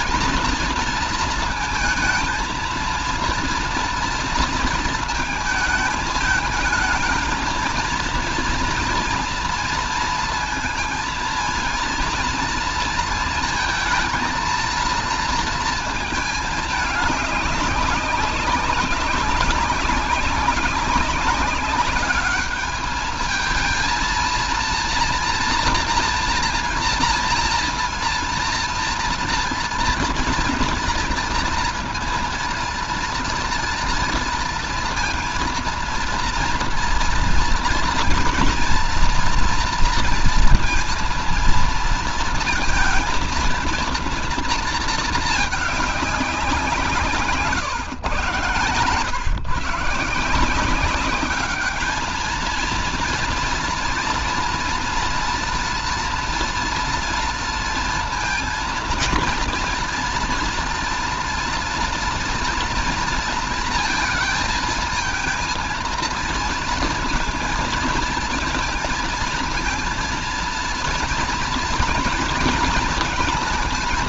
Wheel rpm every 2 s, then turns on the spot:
230, 230, 230, 220, 230, 230, 230, 230, 210, 200, 190, 210, 230, 230, 230, 230, 230, 230, 230, 230, 230, 230, 230, 190, 130, 160, 220, 230, 240, 230, 230, 230, 220, 230, 230, 230, 230.
none